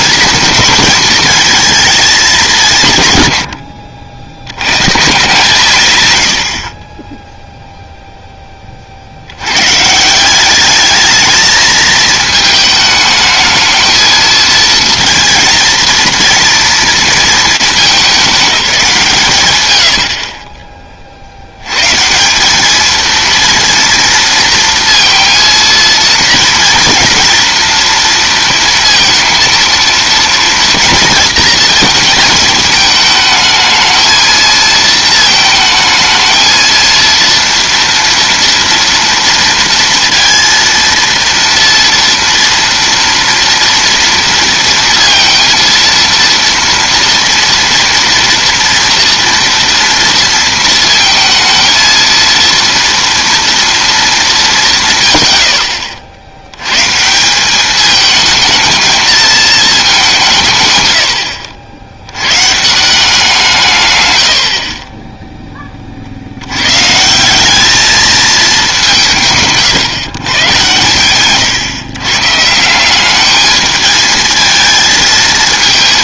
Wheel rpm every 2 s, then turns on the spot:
220, 150, 130, 10, 50, 210, 220, 230, 230, 170, 30, 220, 230, 240, 230, 230, 220, 220, 230, 230, 230, 230, 230, 230, 230, 230, 230, 100, 150, 220, 100, 180, 40, 160, 200, 120, 180, 220.
none